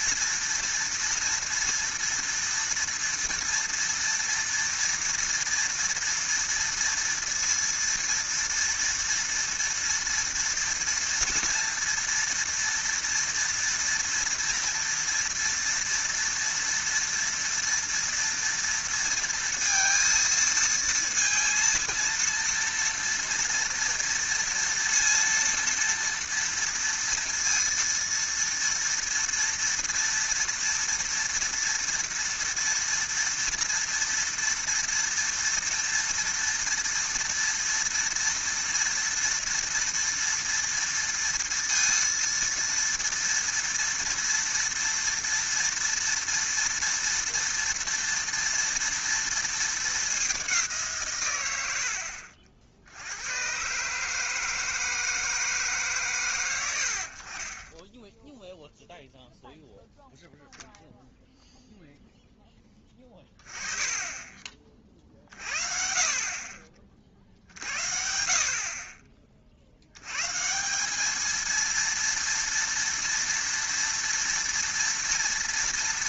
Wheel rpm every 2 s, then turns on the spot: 230, 230, 230, 230, 230, 230, 230, 230, 230, 230, 230, 230, 230, 230, 230, 230, 230, 230, 230, 230, 230, 230, 230, 230, 230, 180, 70, 160, 90, 0, 0, 10, 30, 40, 40, 170, 230, 230.
none